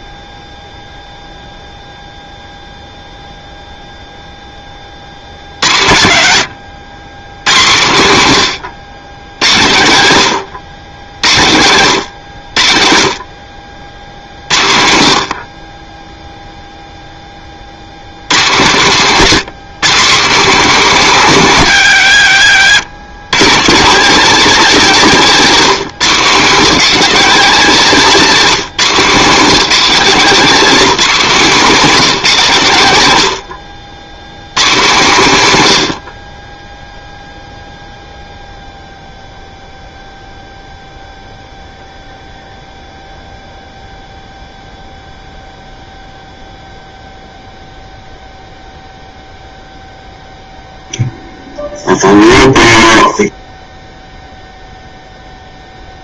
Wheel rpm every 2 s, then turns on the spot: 10, 0, 10, 90, 110, 110, 100, 70, 0, 140, 220, 110, 240, 200, 200, 220, 170, 130, 20, 0, 0, 0, 0, 0, 0, 0, 0, 0.
none